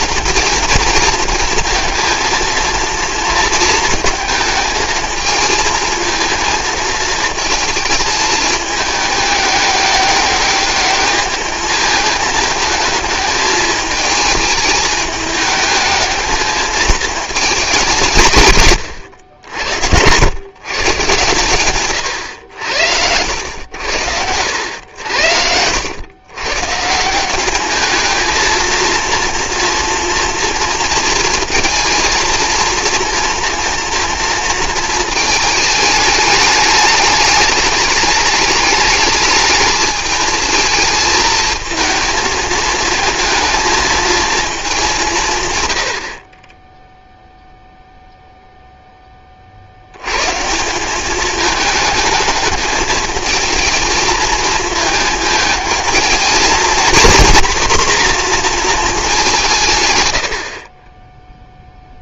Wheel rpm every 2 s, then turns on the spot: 230, 230, 220, 220, 210, 210, 220, 220, 220, 110, 120, 80, 80, 150, 230, 230, 230, 230, 210, 210, 220, 220, 200, 10, 0, 160, 210, 220, 240, 230, 40.
none